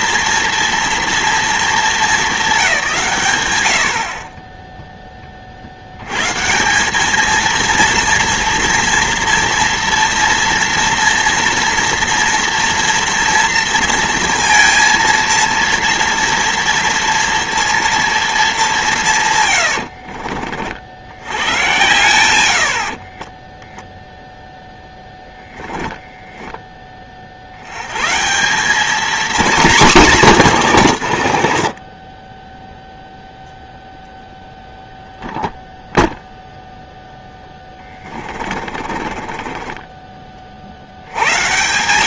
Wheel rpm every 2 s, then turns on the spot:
230, 100, 40, 220, 230, 240, 230, 230, 230, 140, 80, 20, 10, 20, 210, 170, 10, 0, 0, 30, 40.
18-20 22-24 30-32 38-40